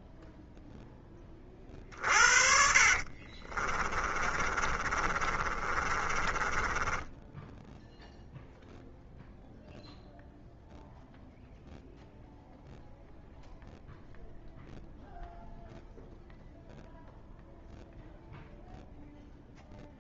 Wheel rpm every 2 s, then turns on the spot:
10, 40, 30, 20, 0, 0, 0, 0, 0, 0.
2-8